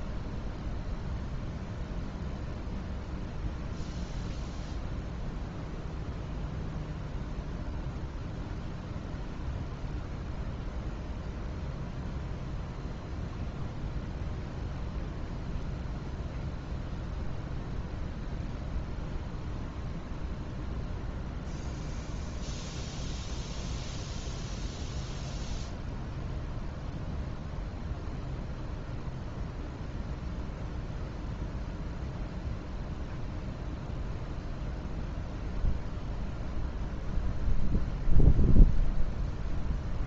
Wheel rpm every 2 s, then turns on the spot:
0, 0, 0, 0, 0, 0, 0, 0, 0, 0, 0, 0, 0, 0, 0, 0, 0, 0, 0, 0.
none